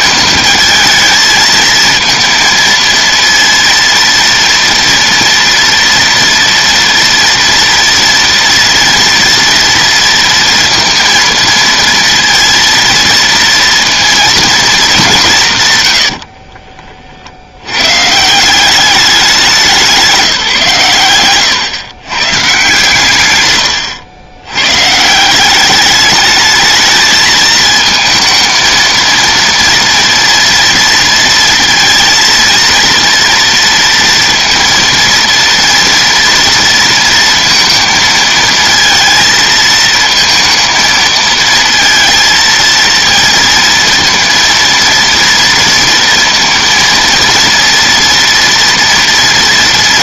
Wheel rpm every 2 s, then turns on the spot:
220, 230, 230, 230, 230, 230, 230, 210, 40, 190, 130, 130, 150, 220, 230, 230, 230, 230, 230, 230, 230, 230, 230, 230, 230.
none